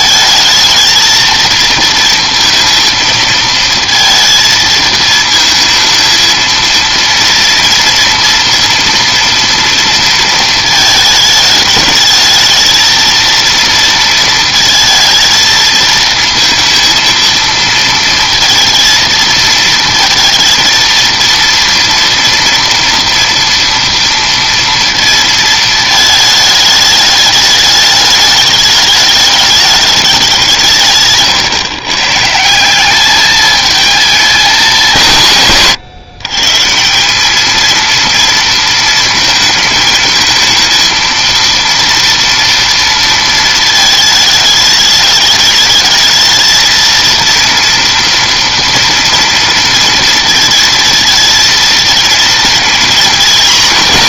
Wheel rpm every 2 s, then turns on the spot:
220, 230, 230, 230, 230, 220, 220, 230, 230, 230, 230, 230, 230, 220, 210, 160, 180, 210, 160, 230, 230, 230, 210, 230, 230, 230, 230.
none